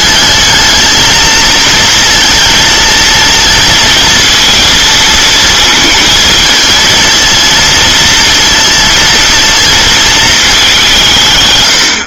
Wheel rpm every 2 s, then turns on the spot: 220, 230, 230, 220, 230, 200.
none